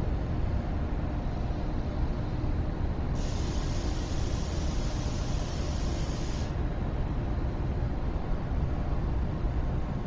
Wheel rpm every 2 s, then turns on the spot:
0, 0, 0, 0, 0.
none